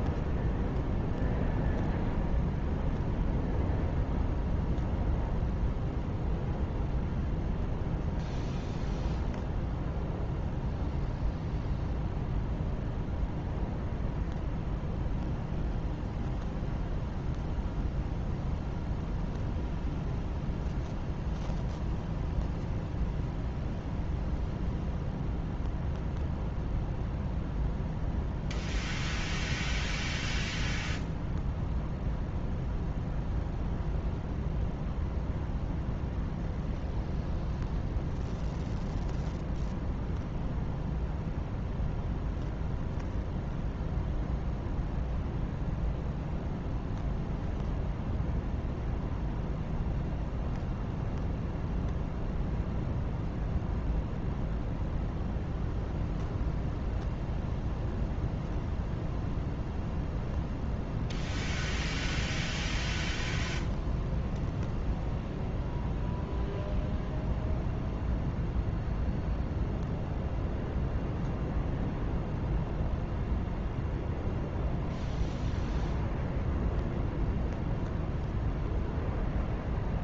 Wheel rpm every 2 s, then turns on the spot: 0, 0, 0, 0, 0, 0, 0, 0, 0, 0, 0, 0, 0, 0, 0, 0, 0, 0, 0, 0, 0, 0, 0, 0, 0, 0, 0, 0, 0, 0, 0, 0, 0, 0, 0, 0, 0, 0, 0, 0.
none